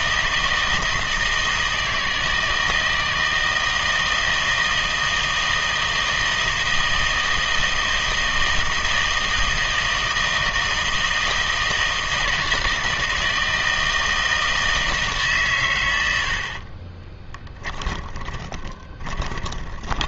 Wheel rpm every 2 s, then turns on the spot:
160, 160, 160, 160, 160, 160, 160, 160, 50, 20.
16-20